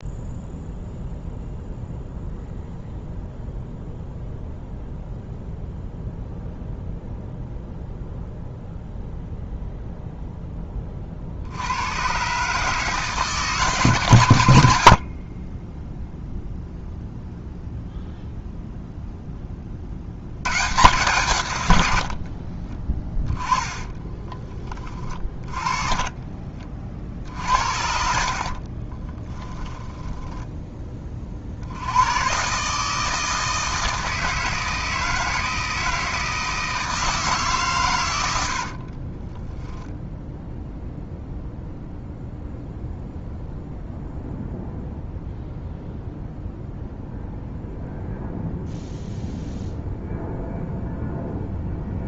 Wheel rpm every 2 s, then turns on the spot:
0, 0, 0, 0, 0, 20, 150, 90, 0, 0, 130, 40, 20, 40, 40, 10, 140, 160, 160, 80, 10, 0, 0, 0, 0, 0.
22-24 28-30 38-40